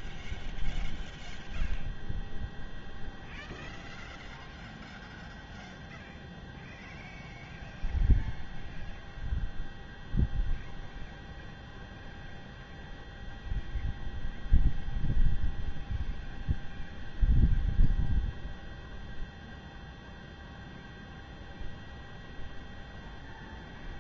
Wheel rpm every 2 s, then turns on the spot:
0, 0, 0, 0, 0, 0, 0, 0, 0, 0, 0, 0.
none